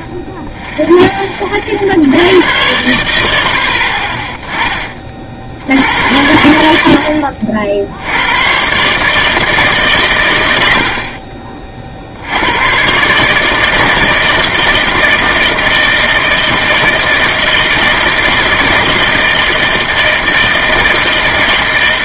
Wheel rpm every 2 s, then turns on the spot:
0, 100, 30, 70, 140, 70, 130, 160, 160, 160, 160.
none